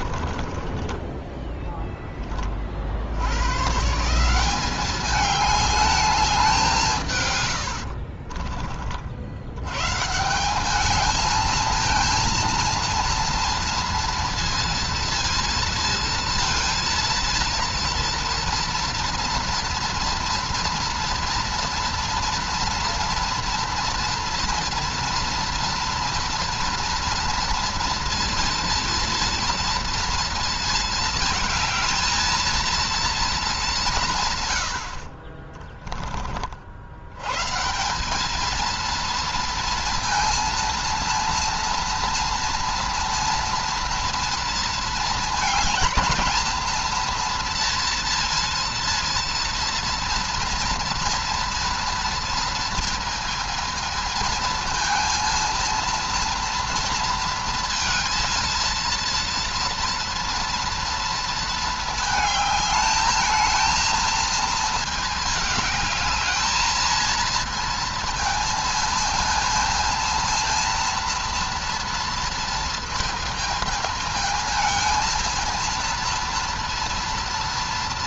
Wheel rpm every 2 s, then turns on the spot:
20, 60, 200, 160, 40, 210, 230, 230, 230, 230, 240, 230, 230, 230, 230, 220, 230, 80, 80, 230, 230, 230, 220, 230, 230, 230, 220, 230, 230, 230, 230, 220, 220, 220, 230, 230, 230, 220, 230.
6-8